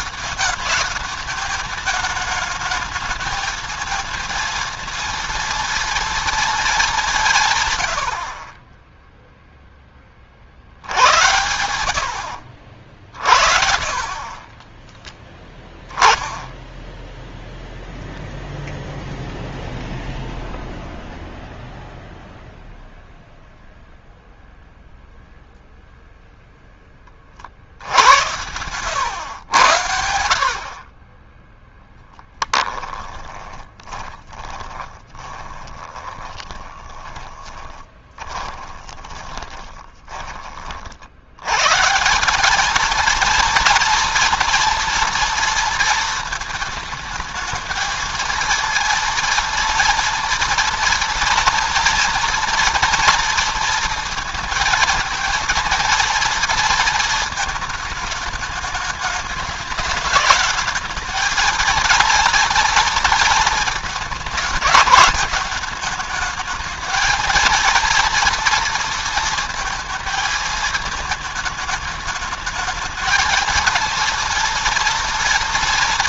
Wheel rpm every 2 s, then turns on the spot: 200, 210, 230, 200, 10, 80, 60, 20, 10, 0, 0, 0, 0, 10, 100, 30, 10, 20, 20, 20, 50, 220, 230, 220, 230, 230, 230, 230, 230, 210, 210, 230, 210, 220, 230, 220, 220, 230.
14-16 32-40